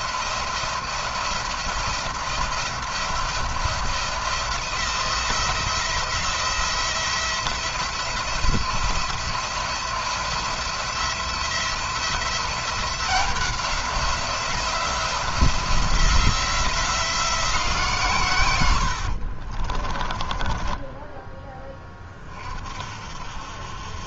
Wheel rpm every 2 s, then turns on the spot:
170, 170, 170, 170, 170, 170, 180, 170, 170, 70, 10, 50.
18-22